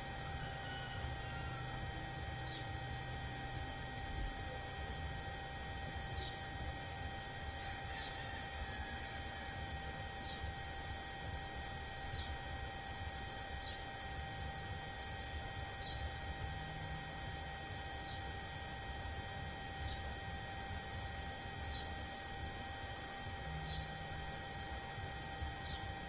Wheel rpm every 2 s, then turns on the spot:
0, 0, 0, 0, 0, 0, 0, 0, 0, 0, 0, 0, 0.
none